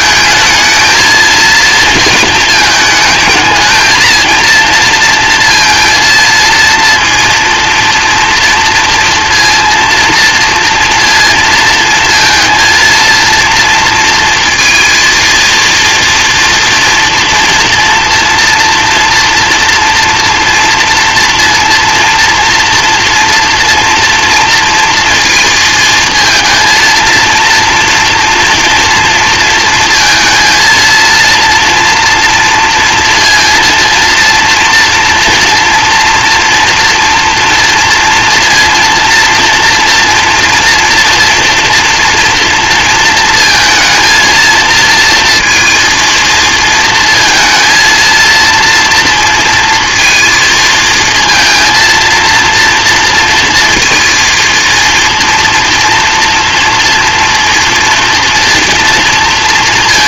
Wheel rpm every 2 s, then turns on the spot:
220, 220, 230, 230, 230, 230, 230, 230, 240, 230, 230, 230, 230, 220, 240, 230, 230, 230, 230, 230, 230, 230, 230, 230, 230, 220, 230, 230, 230, 230.
none